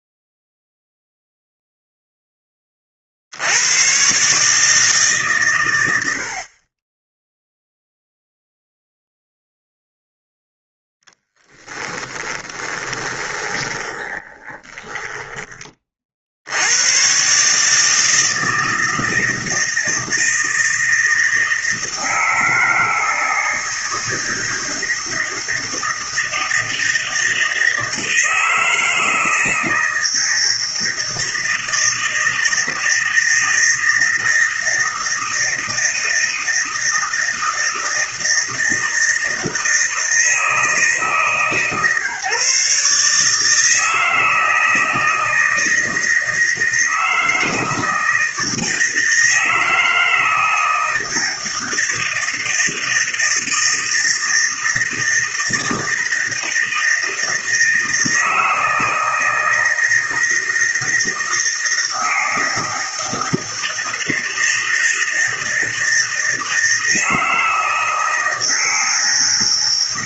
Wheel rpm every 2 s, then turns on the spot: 0, 30, 150, 30, 0, 0, 20, 20, 90, 160, 160, 160, 160, 160, 160, 160, 160, 160, 160, 160, 160, 140, 160, 160, 160, 160, 160, 160, 160, 160, 160, 160, 160, 160, 160.
12-16